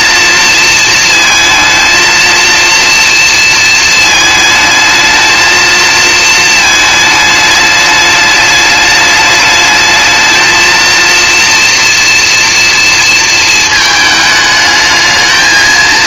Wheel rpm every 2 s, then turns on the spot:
220, 230, 220, 220, 210, 230, 230, 220.
none